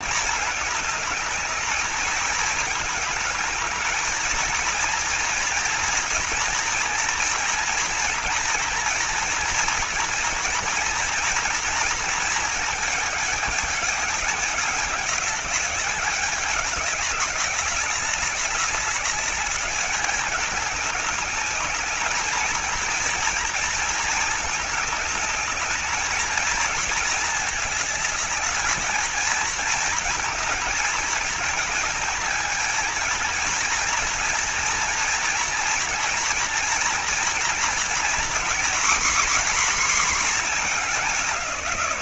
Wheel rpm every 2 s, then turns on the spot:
210, 210, 230, 230, 240, 230, 220, 210, 200, 200, 200, 230, 210, 230, 220, 220, 230, 240, 230, 250, 210.
none